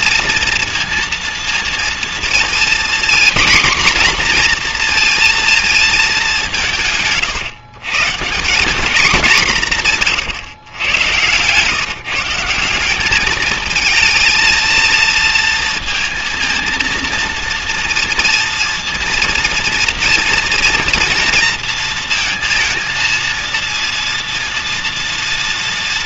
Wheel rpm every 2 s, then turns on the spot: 230, 240, 250, 160, 190, 120, 180, 220, 230, 230, 230, 230, 230.
none